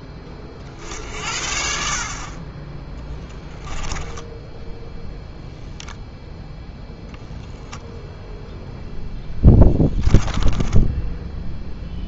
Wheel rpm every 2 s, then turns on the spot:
60, 20, 10, 0, 0, 10.
10-12